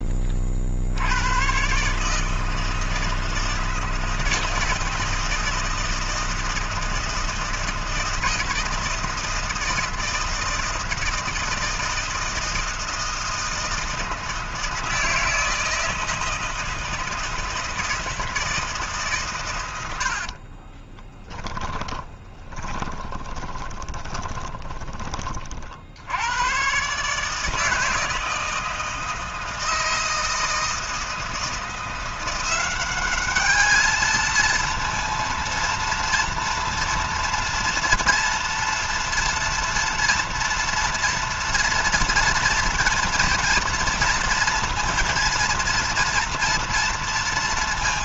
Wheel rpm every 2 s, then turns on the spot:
60, 160, 160, 160, 160, 160, 160, 160, 160, 150, 30, 30, 30, 130, 160, 160, 190, 230, 240, 230, 230, 230, 230, 230.
20-24